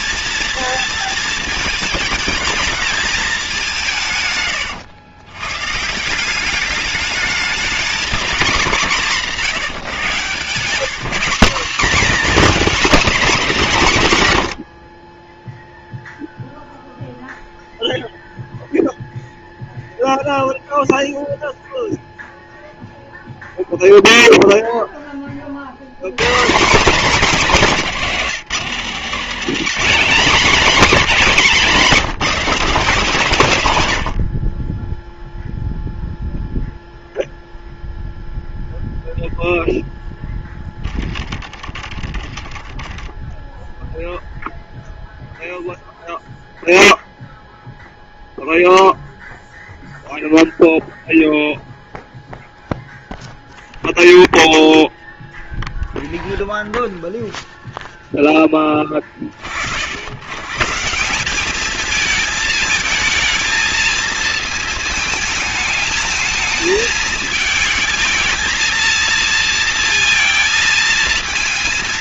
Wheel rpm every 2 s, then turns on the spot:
230, 230, 110, 200, 190, 180, 280, 60, 0, 0, 0, 0, 10, 230, 200, 250, 230, 20, 0, 0, 10, 10, 0, 0, 0, 0, 0, 0, 0, 20, 160, 220, 220, 220, 220, 220.
none